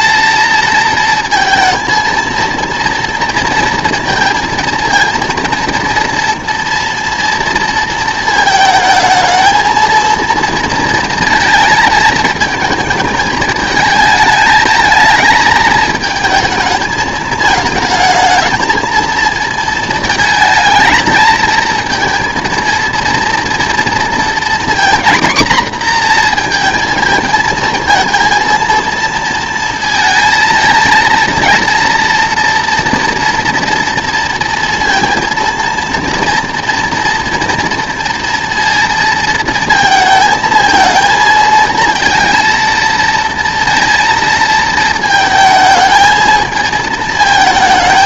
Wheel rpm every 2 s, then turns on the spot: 230, 230, 230, 230, 220, 230, 220, 220, 220, 220, 220, 230, 240, 230, 230, 230, 230, 230, 230, 230, 220, 230, 230, 220.
none